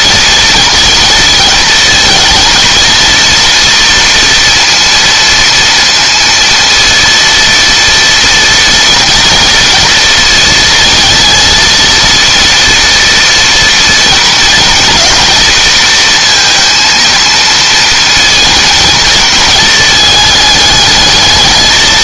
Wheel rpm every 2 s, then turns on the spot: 230, 230, 230, 230, 230, 220, 240, 230, 230, 220, 210.
none